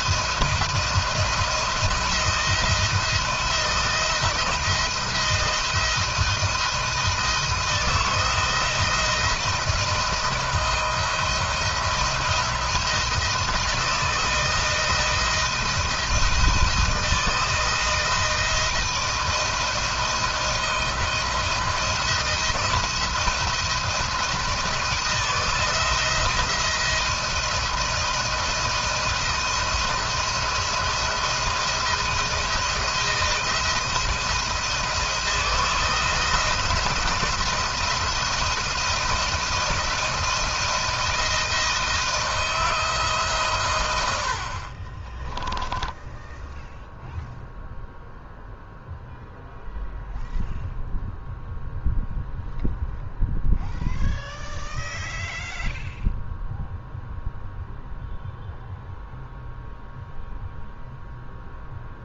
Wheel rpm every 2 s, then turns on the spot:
170, 170, 170, 160, 170, 170, 170, 160, 160, 170, 160, 170, 170, 160, 160, 170, 160, 160, 170, 170, 160, 160, 30, 0, 0, 0, 0, 0, 0, 0, 0.
44-46